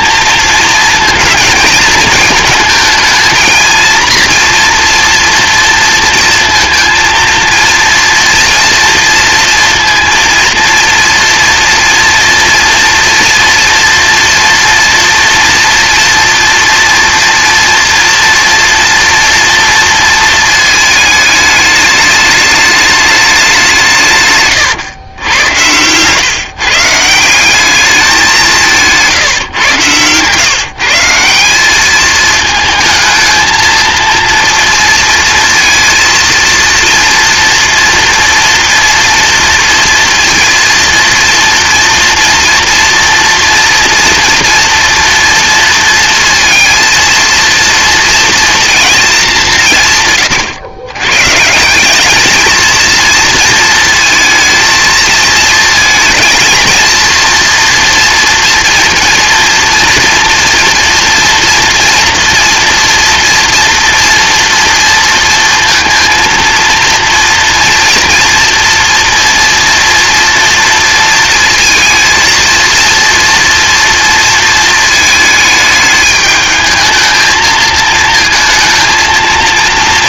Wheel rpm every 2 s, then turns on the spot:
220, 220, 230, 230, 230, 230, 230, 240, 230, 230, 220, 210, 120, 150, 160, 160, 220, 230, 230, 230, 230, 230, 230, 230, 230, 120, 230, 220, 230, 230, 230, 230, 230, 230, 230, 230, 230, 230, 220, 230.
none